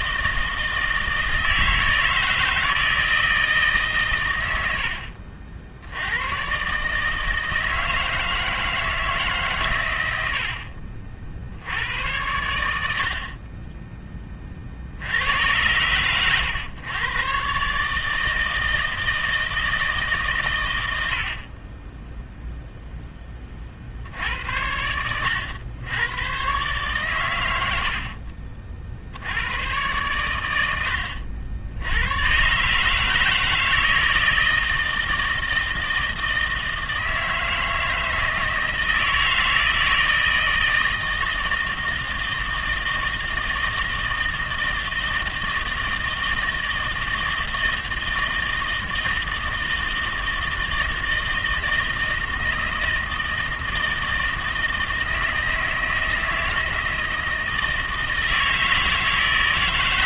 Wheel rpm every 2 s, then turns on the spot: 160, 50, 150, 160, 50, 60, 60, 120, 160, 90, 0, 90, 130, 20, 90, 150, 160, 160, 160, 160, 160, 160, 160, 160, 160, 160, 160, 160, 160, 160.
none